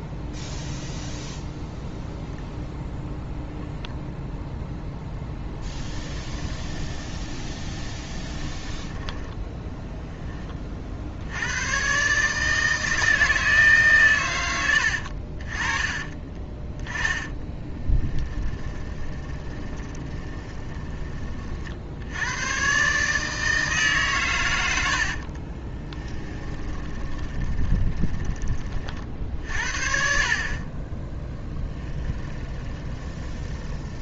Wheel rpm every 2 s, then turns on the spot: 0, 0, 0, 10, 20, 30, 150, 90, 20, 20, 20, 120, 110, 20, 30, 30, 10.
6-10 16-22 26-28 32-34